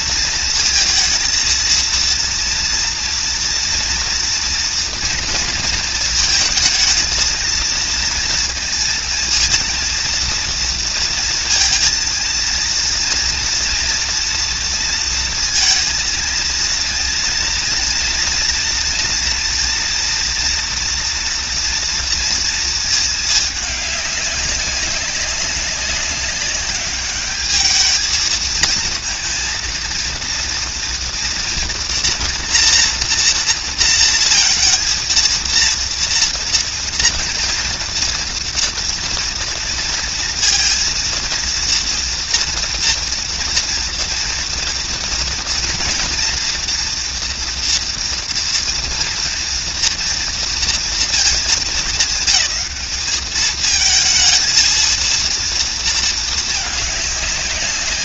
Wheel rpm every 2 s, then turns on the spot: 230, 230, 230, 220, 230, 230, 230, 230, 230, 230, 230, 220, 190, 200, 230, 230, 230, 230, 230, 230, 230, 230, 230, 240, 230, 220, 210, 230, 210.
none